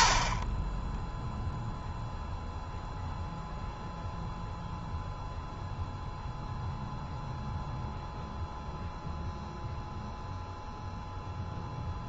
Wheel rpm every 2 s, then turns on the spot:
20, 0, 0, 0, 0, 0.
none